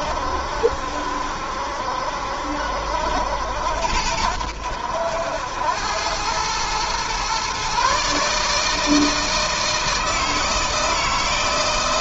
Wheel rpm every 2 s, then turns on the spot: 70, 70, 80, 110, 150, 160.
none